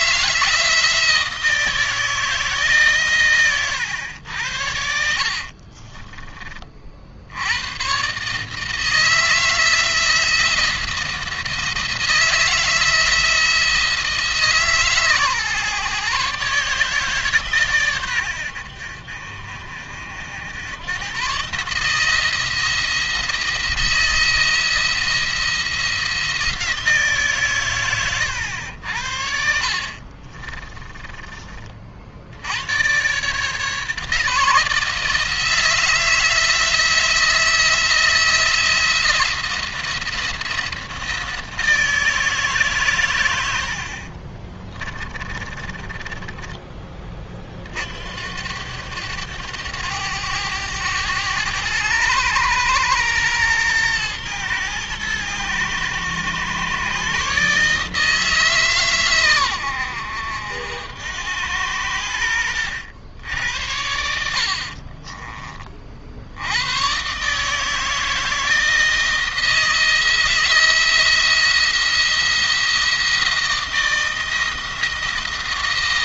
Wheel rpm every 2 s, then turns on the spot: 160, 140, 80, 50, 160, 170, 160, 150, 140, 80, 100, 170, 170, 160, 80, 30, 110, 160, 170, 170, 170, 130, 30, 20, 90, 100, 110, 110, 130, 130, 80, 90, 40, 110, 160, 170, 170, 160.
4-6 30-32 44-46 64-66